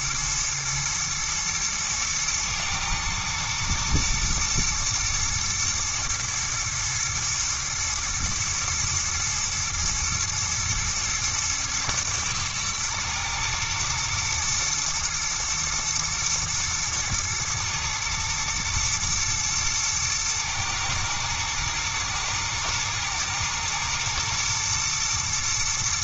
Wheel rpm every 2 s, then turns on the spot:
120, 110, 120, 110, 110, 110, 110, 120, 120, 120, 120, 110, 110.
none